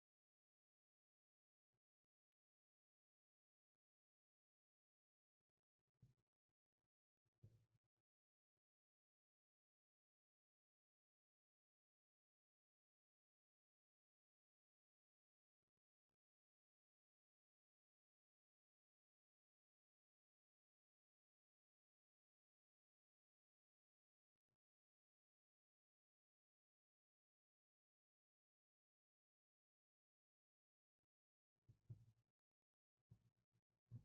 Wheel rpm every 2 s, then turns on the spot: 0, 0, 0, 0, 0, 0, 0, 0, 0, 0, 0, 0, 0, 0, 0, 0, 0.
none